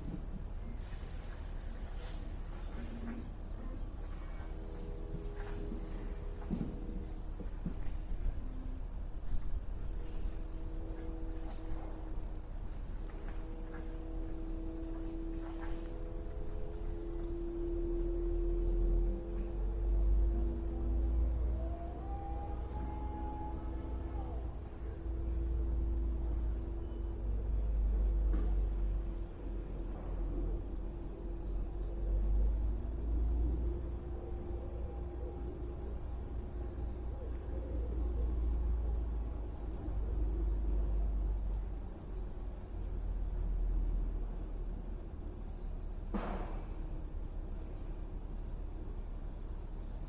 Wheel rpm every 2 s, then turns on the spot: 0, 0, 0, 0, 0, 0, 0, 0, 0, 0, 0, 0, 0, 0, 0, 0, 0, 0, 0, 0, 0, 0, 0, 0, 0.
none